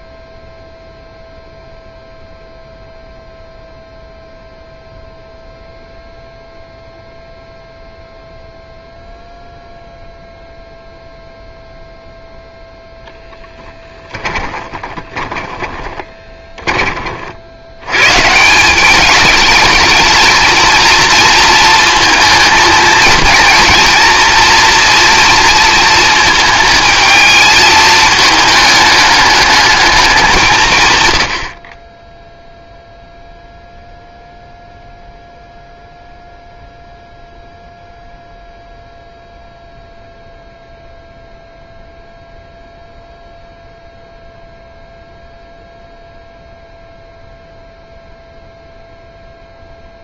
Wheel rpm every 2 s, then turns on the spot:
0, 0, 0, 0, 0, 0, 0, 10, 20, 170, 230, 230, 240, 220, 220, 160, 0, 0, 0, 0, 0, 0, 0, 0, 0.
14-18